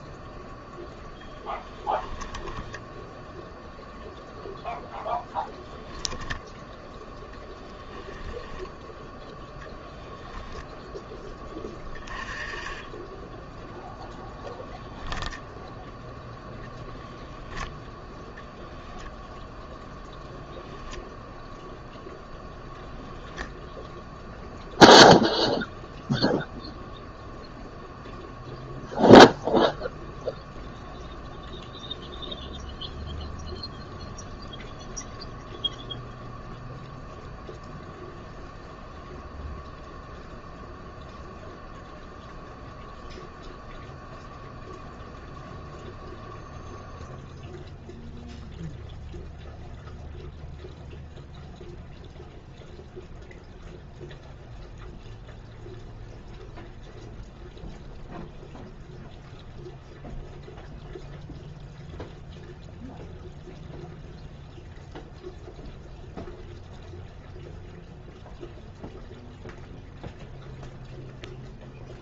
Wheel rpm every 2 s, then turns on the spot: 0, 10, 0, 0, 10, 10, 10, 0, 0, 0, 0, 0, 0, 0, 0, 0, 0, 0, 0, 0, 0, 0, 0, 0, 0, 0, 0, 0, 0, 0, 0, 0, 0, 0, 0, 0.
none